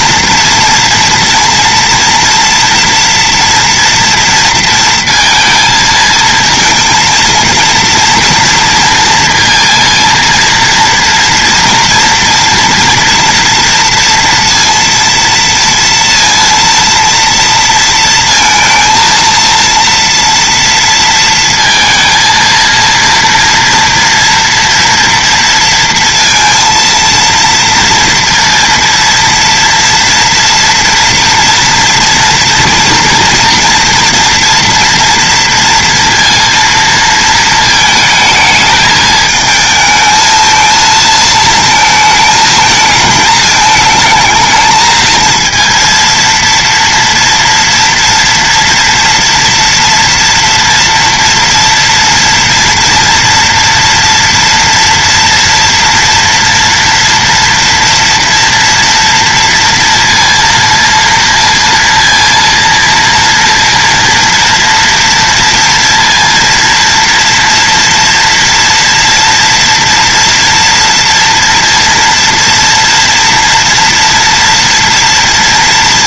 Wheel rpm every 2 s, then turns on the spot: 230, 230, 230, 220, 230, 230, 230, 230, 230, 230, 230, 230, 230, 230, 230, 230, 230, 230, 230, 220, 220, 220, 220, 230, 240, 230, 230, 230, 230, 230, 230, 230, 230, 230, 230, 230, 230, 230.
none